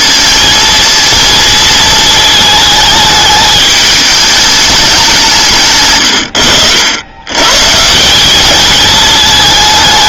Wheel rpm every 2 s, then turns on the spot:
230, 220, 210, 80, 210.
none